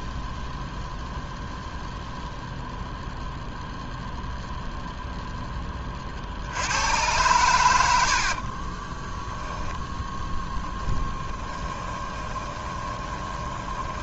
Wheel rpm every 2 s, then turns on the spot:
0, 0, 0, 90, 20, 10, 20.
10-14